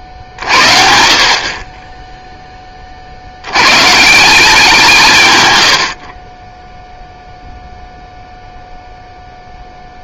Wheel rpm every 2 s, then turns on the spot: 60, 20, 170, 10, 0.
none